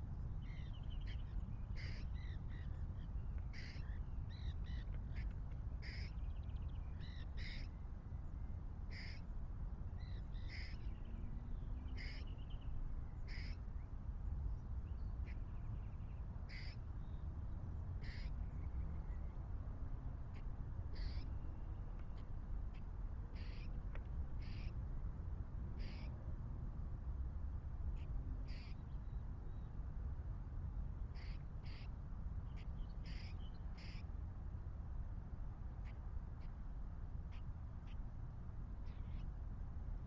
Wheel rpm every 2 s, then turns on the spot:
0, 0, 0, 0, 0, 0, 0, 0, 0, 0, 0, 0, 0, 0, 0, 0, 0, 0, 0, 0.
none